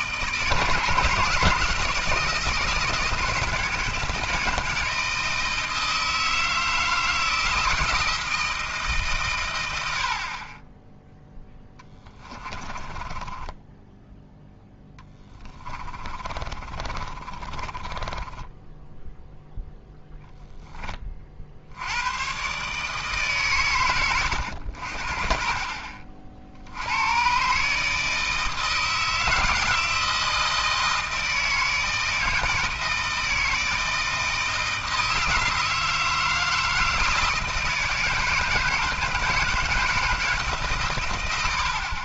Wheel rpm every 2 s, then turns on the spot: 160, 170, 160, 160, 160, 30, 20, 10, 30, 10, 10, 140, 70, 70, 160, 160, 160, 160, 160, 160, 140.
12-20